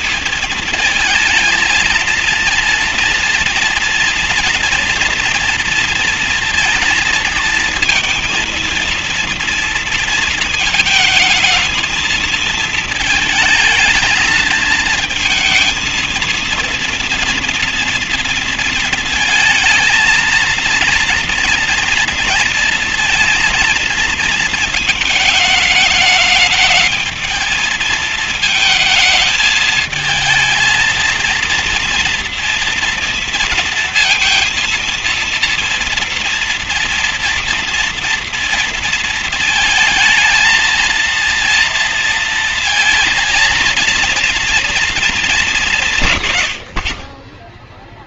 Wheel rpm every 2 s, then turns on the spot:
220, 230, 230, 230, 230, 220, 220, 230, 230, 230, 230, 230, 230, 210, 220, 230, 230, 230, 230, 230, 220, 230, 230, 100.
none